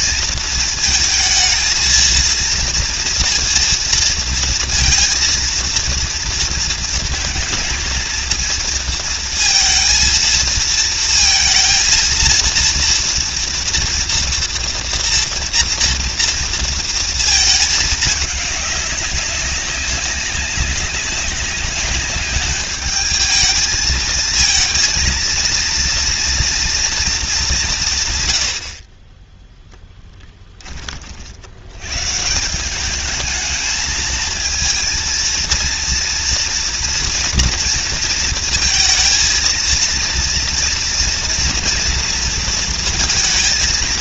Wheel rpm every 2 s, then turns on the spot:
220, 230, 230, 230, 230, 230, 230, 230, 230, 200, 200, 210, 230, 230, 80, 20, 180, 230, 240, 220, 230, 230.
none